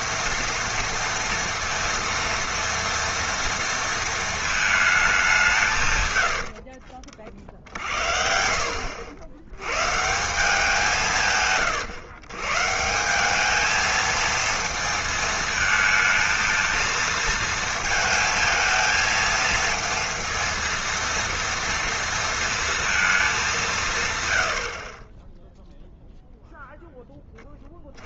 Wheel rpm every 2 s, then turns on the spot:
230, 230, 220, 60, 80, 170, 140, 220, 230, 220, 230, 230, 70, 0.
6-8